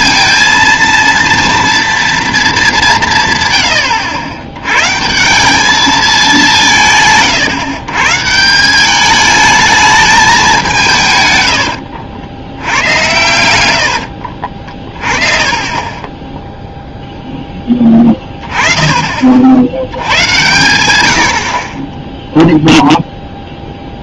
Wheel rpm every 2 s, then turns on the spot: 230, 200, 120, 160, 190, 180, 100, 40, 0, 20, 110, 0.
14-16